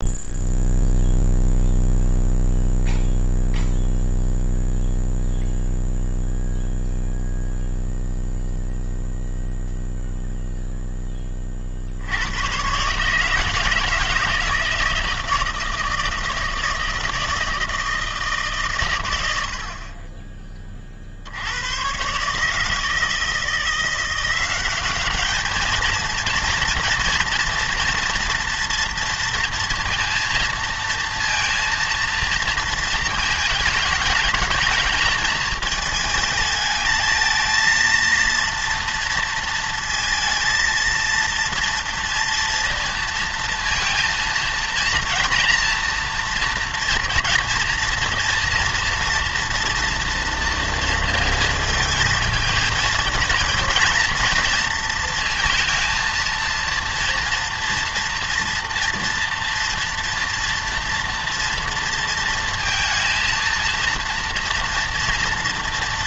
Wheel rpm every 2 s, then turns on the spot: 0, 0, 0, 0, 0, 0, 120, 160, 160, 140, 20, 150, 190, 230, 230, 230, 220, 210, 220, 230, 220, 230, 230, 230, 240, 230, 230, 230, 230, 230, 230, 230, 230.
none